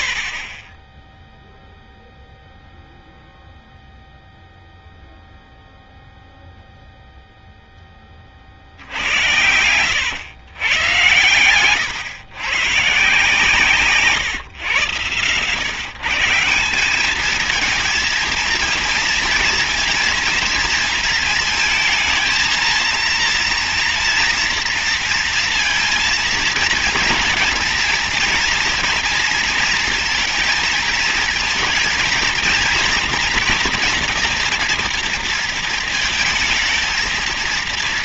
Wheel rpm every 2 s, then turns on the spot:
40, 0, 0, 0, 60, 100, 130, 120, 180, 230, 230, 230, 230, 230, 230, 230, 230, 230, 220.
none